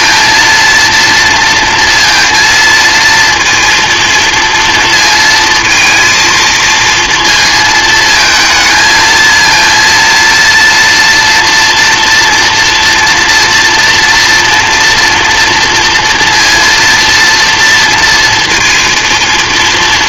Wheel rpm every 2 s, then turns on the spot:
230, 230, 230, 230, 220, 230, 230, 240, 230, 230.
none